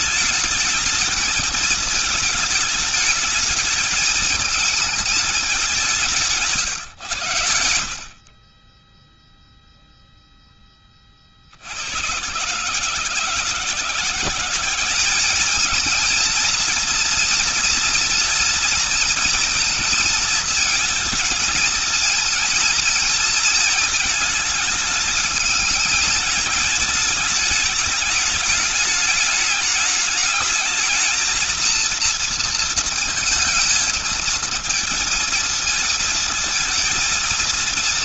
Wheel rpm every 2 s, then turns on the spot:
220, 220, 220, 140, 20, 20, 140, 190, 230, 230, 230, 230, 220, 220, 210, 210, 230, 220, 220.
none